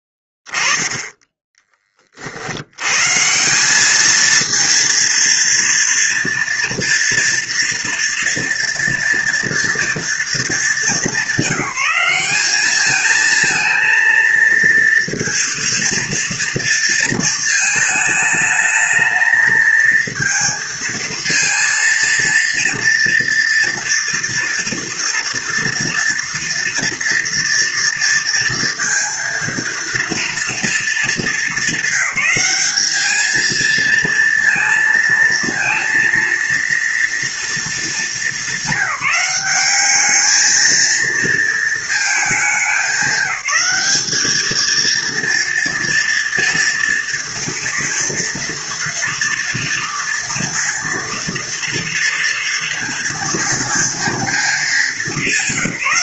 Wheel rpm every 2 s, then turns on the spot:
10, 80, 230, 230, 230, 220, 200, 230, 230, 220, 230, 230, 230, 230, 230, 230, 200, 230, 230, 210, 220, 200, 220, 230, 230, 230, 230, 220.
0-2